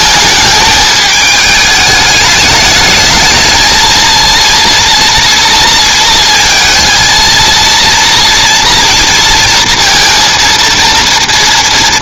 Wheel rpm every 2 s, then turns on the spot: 220, 210, 240, 230, 230, 230.
none